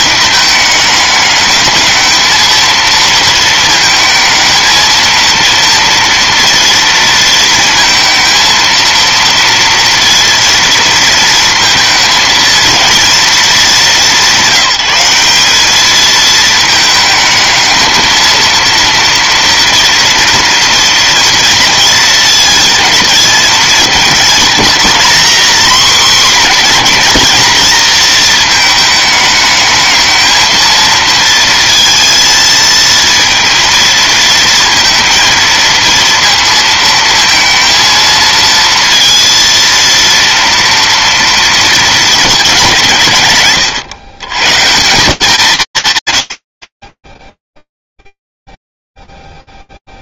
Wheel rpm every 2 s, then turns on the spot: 210, 230, 230, 230, 230, 230, 230, 180, 220, 230, 230, 220, 230, 230, 220, 230, 230, 230, 230, 230, 230, 180, 100, 70, 0.
none